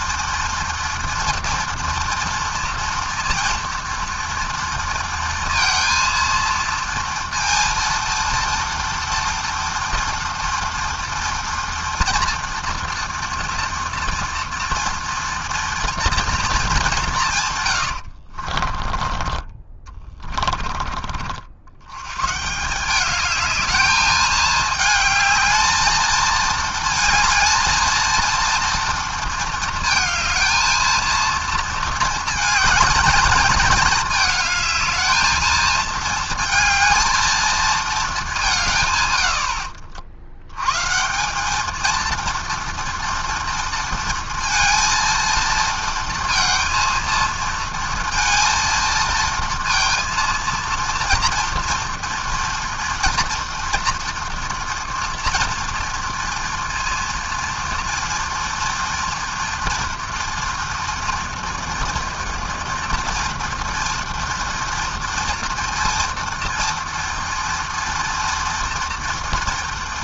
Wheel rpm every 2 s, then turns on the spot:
230, 230, 230, 230, 240, 240, 240, 230, 150, 20, 60, 210, 220, 220, 230, 230, 220, 220, 220, 90, 190, 230, 230, 230, 230, 230, 230, 230, 230, 230, 230, 230, 230, 240, 240.
none